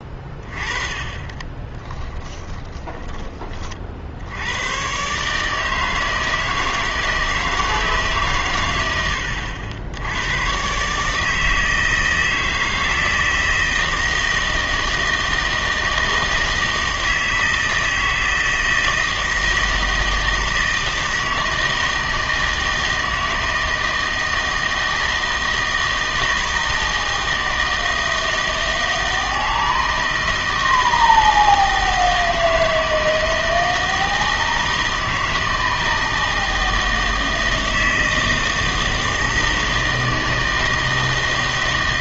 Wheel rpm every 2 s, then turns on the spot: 30, 20, 100, 160, 110, 130, 160, 160, 160, 160, 160, 160, 160, 160, 160, 160, 160, 160, 160, 160, 160.
0-4